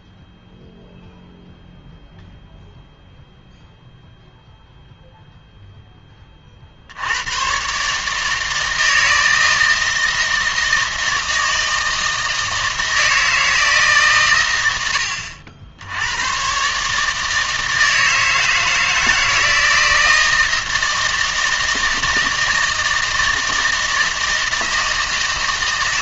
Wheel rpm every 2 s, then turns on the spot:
0, 0, 0, 60, 160, 160, 160, 80, 140, 160, 160, 160, 160.
none